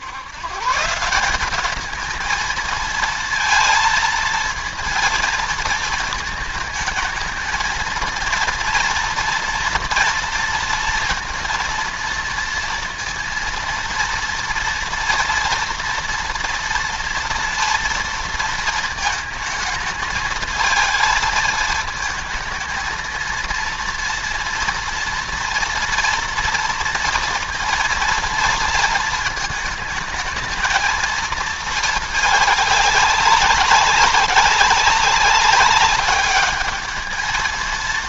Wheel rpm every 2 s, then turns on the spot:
160, 220, 230, 220, 230, 230, 230, 230, 240, 230, 220, 220, 230, 230, 230, 220, 210, 200, 210.
none